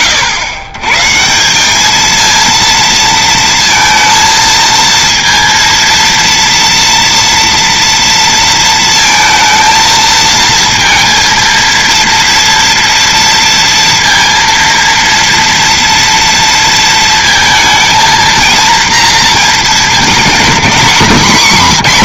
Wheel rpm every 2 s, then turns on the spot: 110, 230, 230, 230, 230, 230, 230, 230, 230, 230, 220.
none